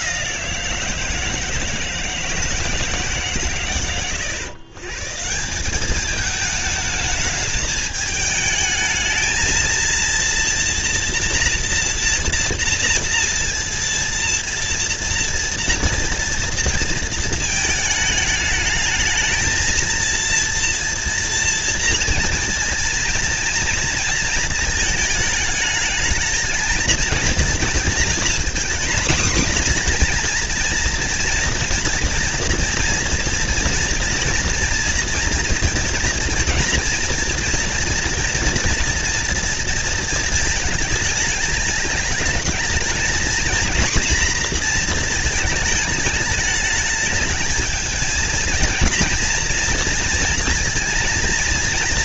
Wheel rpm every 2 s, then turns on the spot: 180, 160, 130, 220, 210, 230, 230, 230, 230, 210, 230, 230, 230, 230, 240, 240, 230, 230, 230, 230, 220, 210, 230, 210, 230, 230.
none